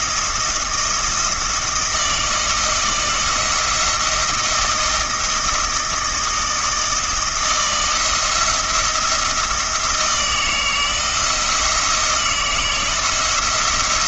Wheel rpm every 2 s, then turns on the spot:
170, 160, 160, 160, 170, 160, 160.
none